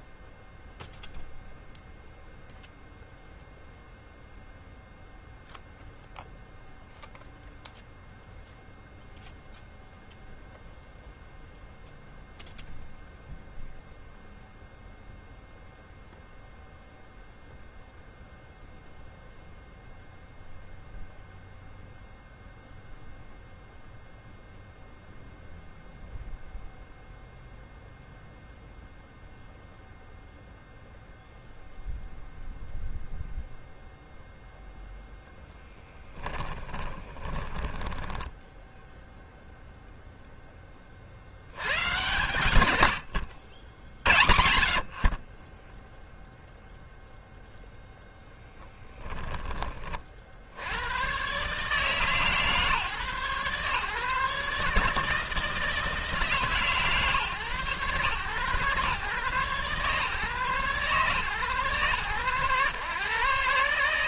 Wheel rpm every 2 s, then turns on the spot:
0, 0, 0, 0, 0, 0, 0, 0, 0, 0, 0, 0, 0, 0, 0, 0, 0, 0, 20, 0, 30, 100, 60, 0, 10, 90, 140, 150, 140, 120, 140, 130.
36-38 44-46 48-50